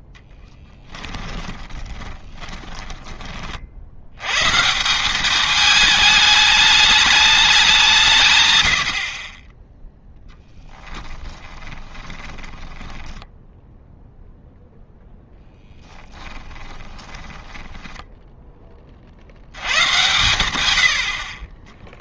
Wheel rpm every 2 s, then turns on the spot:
10, 10, 150, 210, 100, 10, 10, 0, 10, 20, 100.
0-4 12-14 16-18